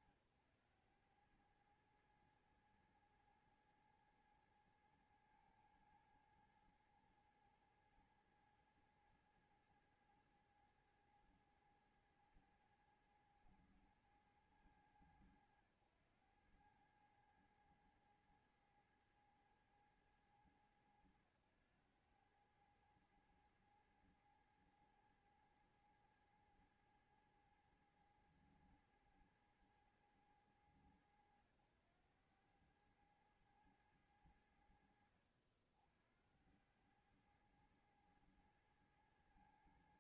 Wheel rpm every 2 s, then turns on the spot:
100, 110, 110, 110, 110, 110, 110, 110, 100, 110, 100, 100, 110, 110, 110, 100, 100, 80, 80, 110.
none